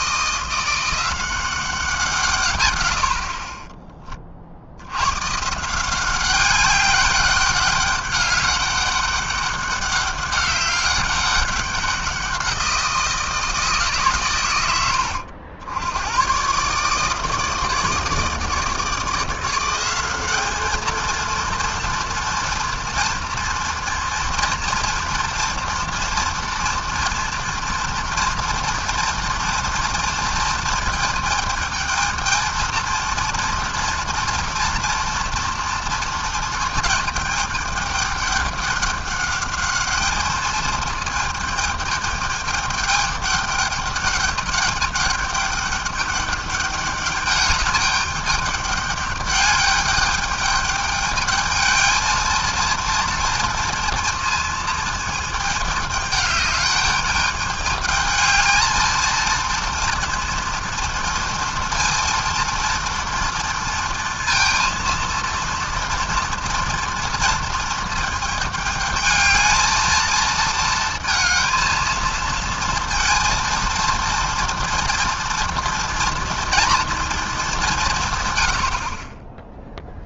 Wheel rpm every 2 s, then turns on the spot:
170, 130, 60, 190, 200, 200, 180, 110, 130, 160, 210, 230, 230, 230, 230, 220, 230, 230, 220, 200, 220, 210, 200, 210, 200, 210, 230, 230, 210, 220, 230, 230, 230, 230, 220, 230, 230, 230, 230, 110.
none